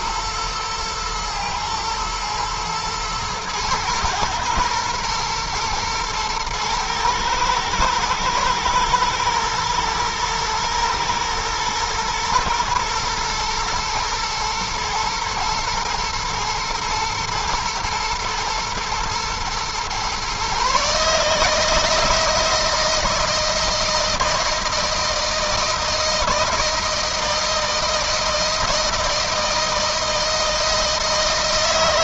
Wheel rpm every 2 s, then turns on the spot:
110, 110, 110, 110, 110, 120, 120, 110, 120, 120, 150, 160, 160, 160, 160, 160.
none